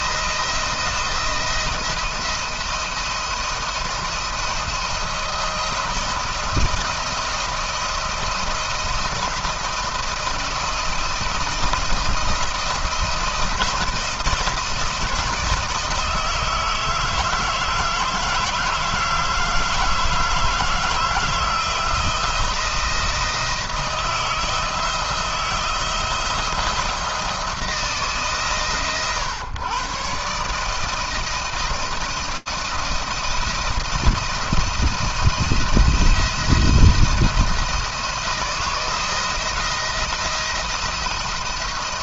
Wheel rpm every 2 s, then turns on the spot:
170, 170, 170, 170, 170, 170, 170, 170, 160, 160, 160, 170, 160, 160, 120, 160, 170, 170, 170, 160, 170.
none